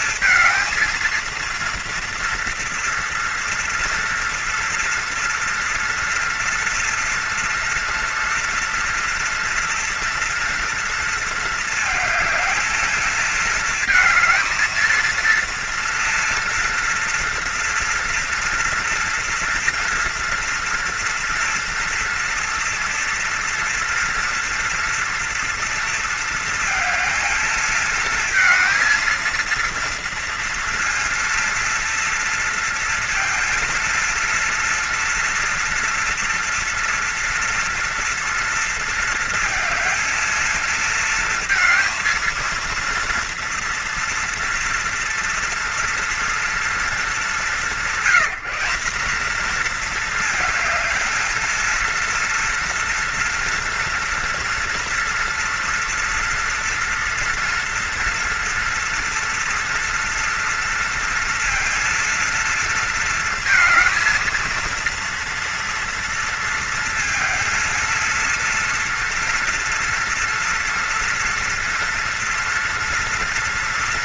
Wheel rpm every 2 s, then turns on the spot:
230, 230, 230, 230, 230, 230, 220, 230, 230, 240, 230, 240, 230, 230, 230, 230, 230, 230, 230, 230, 230, 230, 230, 230, 210, 230, 230, 230, 230, 230, 230, 230, 230, 220, 230, 230, 230.
none